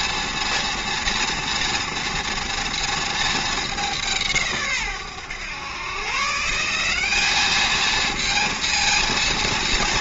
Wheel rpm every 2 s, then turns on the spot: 230, 240, 150, 170, 230.
none